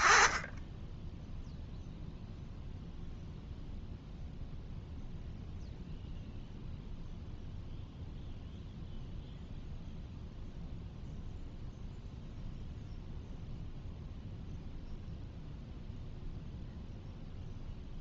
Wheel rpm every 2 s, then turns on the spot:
10, 0, 0, 0, 0, 0, 0, 0, 0.
none